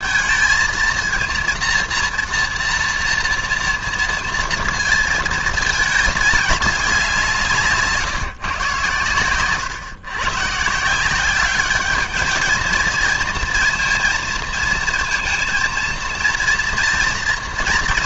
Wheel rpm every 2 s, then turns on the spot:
220, 230, 230, 200, 130, 150, 220, 230, 230.
none